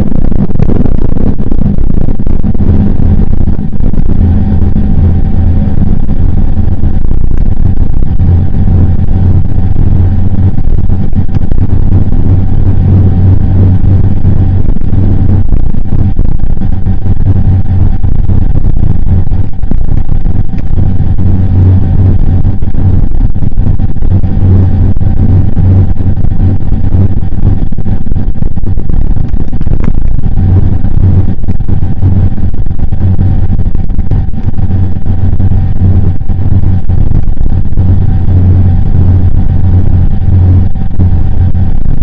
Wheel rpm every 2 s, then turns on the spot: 0, 0, 0, 0, 0, 0, 0, 0, 0, 0, 0, 0, 0, 0, 0, 0, 0, 0, 0, 0, 0.
none